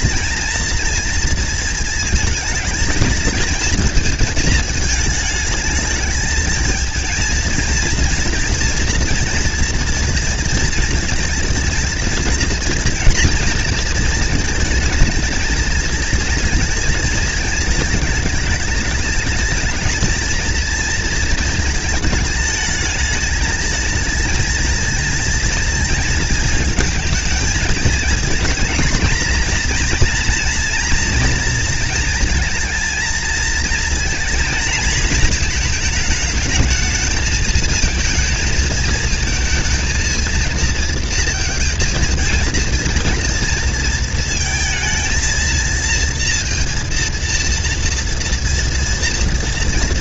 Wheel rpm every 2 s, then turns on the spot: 230, 220, 210, 230, 240, 240, 230, 230, 220, 220, 230, 220, 220, 220, 230, 230, 220, 230, 220, 220, 230, 230, 230, 230, 240.
none